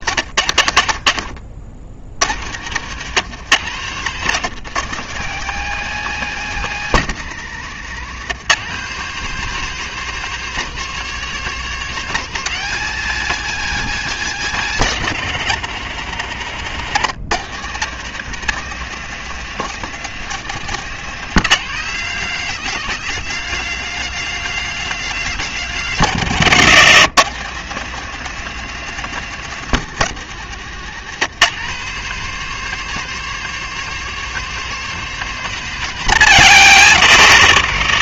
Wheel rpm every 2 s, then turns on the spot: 60, 150, 170, 170, 180, 200, 200, 180, 150, 190, 180, 200, 190, 150, 190, 160, 200, 190, 130.
0-2